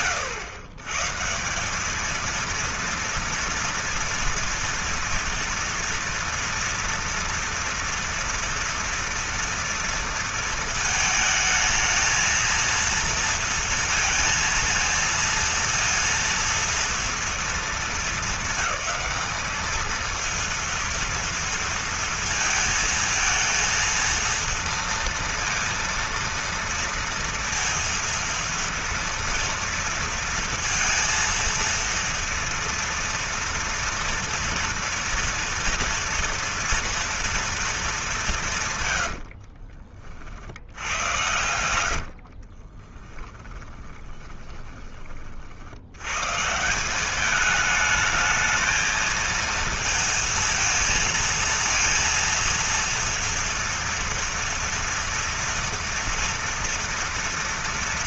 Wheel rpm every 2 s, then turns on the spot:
130, 230, 230, 230, 230, 220, 230, 230, 230, 210, 230, 220, 230, 230, 230, 230, 230, 230, 230, 130, 80, 20, 30, 190, 220, 230, 240, 230, 230.
38-40 42-44